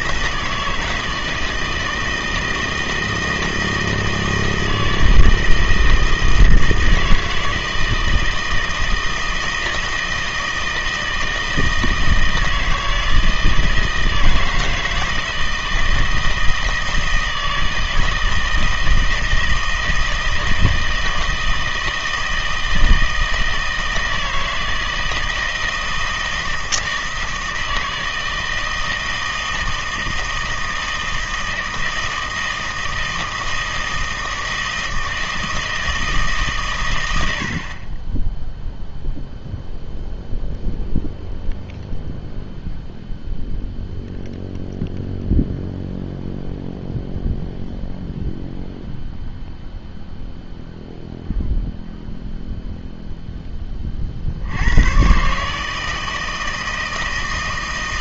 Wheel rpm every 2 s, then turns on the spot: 160, 160, 160, 160, 160, 160, 160, 160, 160, 160, 160, 160, 160, 160, 160, 160, 160, 160, 130, 0, 0, 0, 0, 0, 0, 0, 0, 90, 160.
none